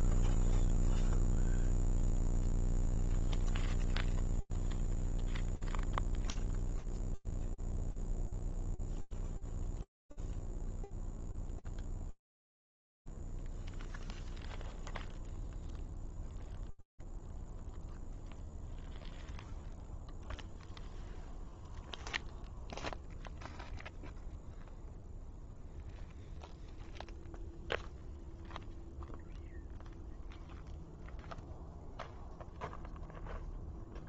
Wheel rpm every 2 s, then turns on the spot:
0, 0, 0, 0, 0, 0, 0, 0, 0, 0, 0, 0, 0, 0, 0, 0, 0.
none